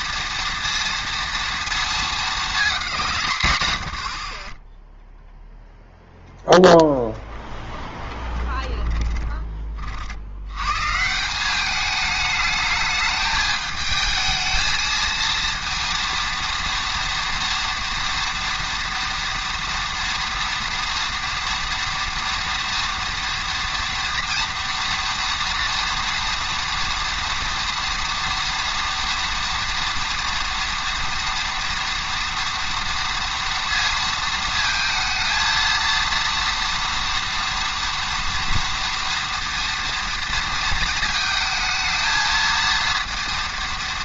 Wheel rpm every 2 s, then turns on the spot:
230, 220, 20, 0, 20, 100, 210, 220, 230, 230, 230, 230, 230, 240, 230, 230, 230, 220, 230, 230, 220, 230.
8-10